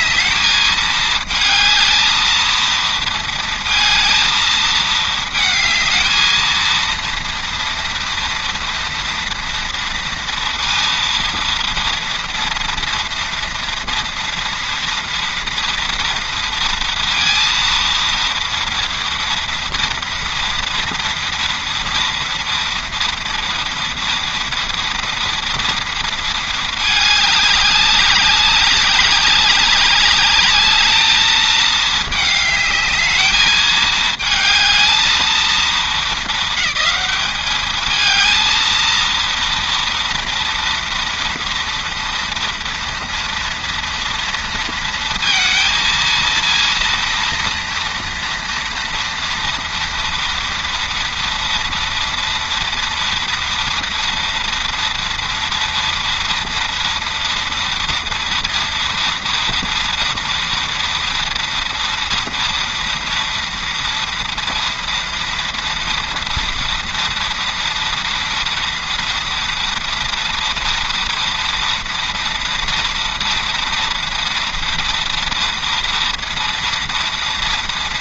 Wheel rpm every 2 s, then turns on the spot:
220, 230, 220, 230, 230, 230, 230, 230, 230, 230, 240, 230, 240, 210, 200, 210, 210, 220, 200, 230, 230, 230, 230, 230, 230, 230, 230, 230, 240, 230, 230, 230, 230, 230, 230, 230, 230, 230, 230.
none